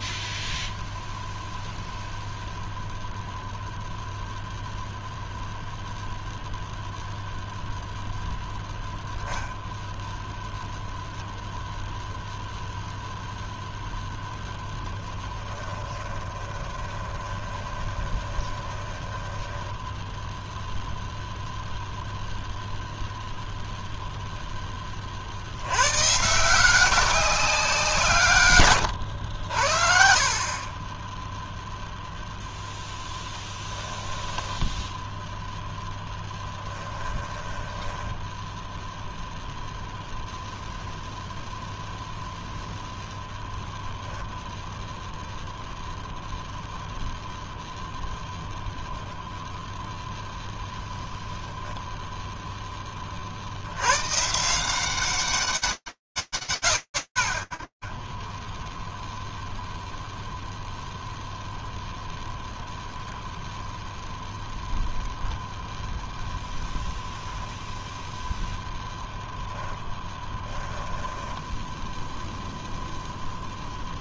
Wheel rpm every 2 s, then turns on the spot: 0, 0, 0, 0, 0, 0, 0, 10, 20, 10, 0, 0, 30, 190, 100, 20, 10, 0, 10, 0, 0, 0, 0, 0, 10, 0, 10, 150, 20, 0, 0, 0, 0, 0, 10, 10, 0.
14-20 36-38 70-72